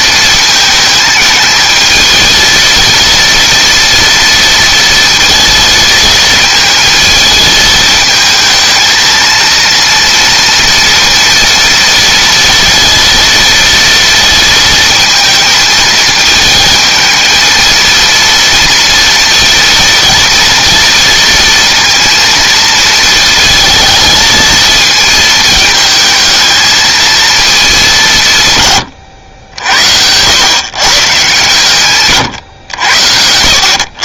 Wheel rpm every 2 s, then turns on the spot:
220, 230, 230, 230, 220, 230, 230, 230, 220, 230, 230, 230, 230, 220, 110, 130, 90.
none